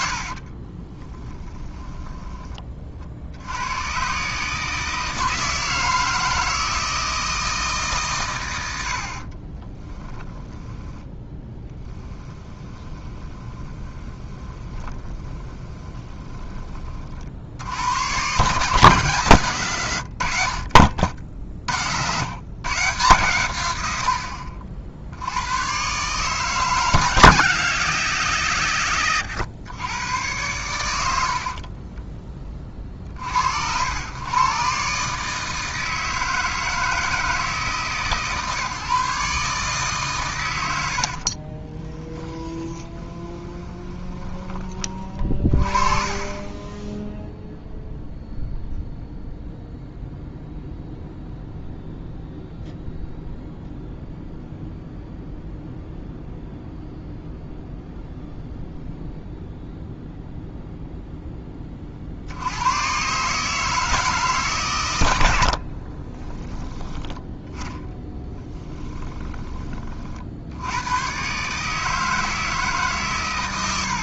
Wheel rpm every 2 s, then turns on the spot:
30, 20, 150, 160, 90, 10, 20, 20, 30, 140, 50, 130, 60, 150, 130, 100, 30, 130, 160, 140, 100, 10, 20, 10, 0, 0, 0, 0, 0, 0, 0, 90, 130, 10, 20, 80, 150.
0-2 10-16 42-44 66-70